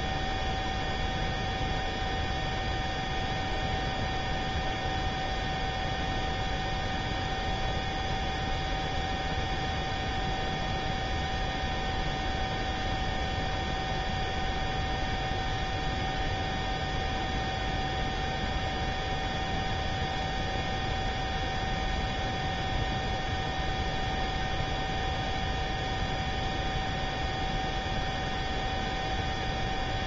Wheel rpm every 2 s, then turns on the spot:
0, 0, 0, 0, 0, 0, 0, 0, 0, 0, 0, 0, 0, 0, 0.
none